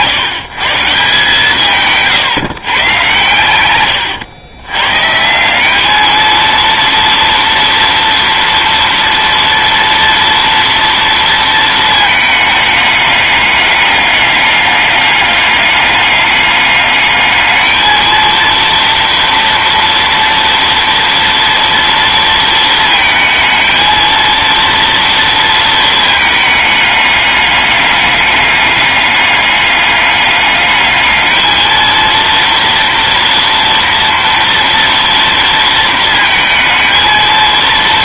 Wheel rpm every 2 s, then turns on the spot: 160, 150, 120, 230, 230, 230, 210, 200, 210, 230, 230, 230, 230, 210, 210, 210, 230, 230, 220.
none